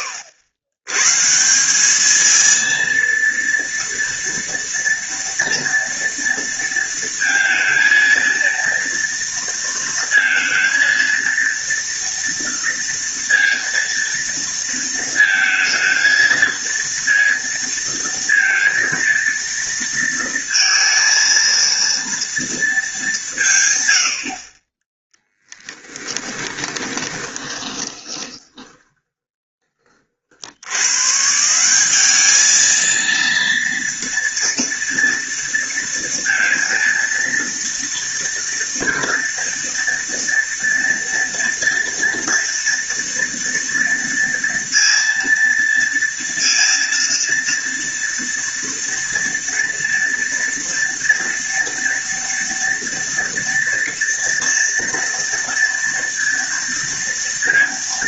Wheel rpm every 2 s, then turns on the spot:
100, 230, 230, 230, 230, 230, 230, 230, 230, 230, 230, 210, 20, 20, 20, 140, 220, 230, 230, 230, 230, 230, 230, 230, 230, 230, 230, 230, 230.
26-30